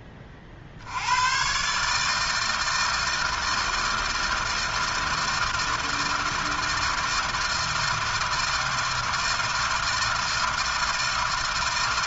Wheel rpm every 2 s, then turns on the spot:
60, 160, 160, 160, 160, 160.
none